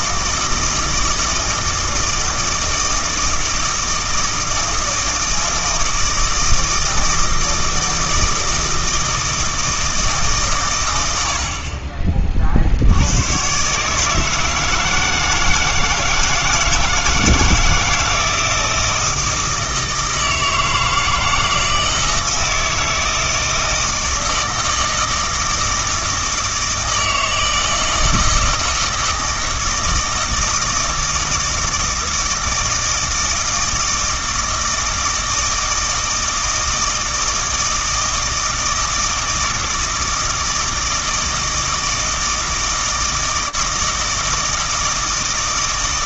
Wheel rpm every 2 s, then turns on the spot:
160, 160, 160, 160, 160, 120, 50, 160, 160, 160, 160, 160, 160, 160, 160, 160, 160, 160, 160, 160, 160, 160, 160.
none